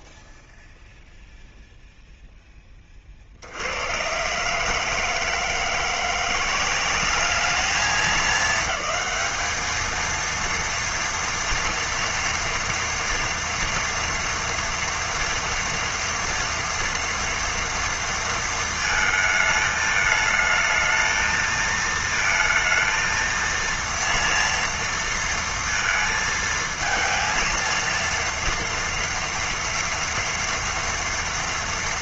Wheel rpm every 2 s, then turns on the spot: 0, 30, 150, 190, 220, 230, 230, 230, 230, 220, 220, 230, 230, 230, 230, 230.
none